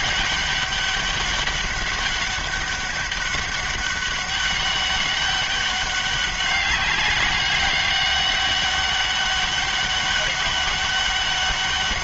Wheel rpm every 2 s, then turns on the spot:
200, 200, 200, 200, 200, 200.
none